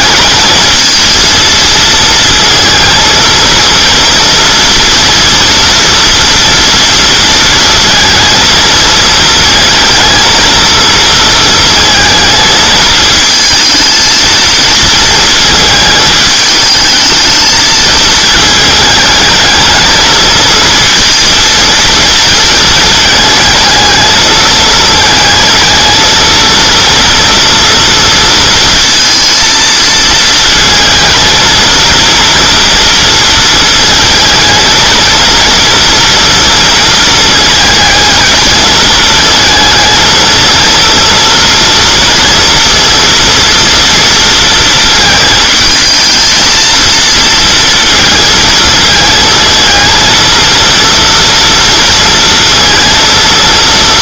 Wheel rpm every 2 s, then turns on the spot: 220, 230, 240, 230, 220, 230, 220, 230, 220, 220, 230, 220, 220, 230, 230, 220, 230, 220, 230, 220, 230, 230, 230, 220, 230, 230, 230.
none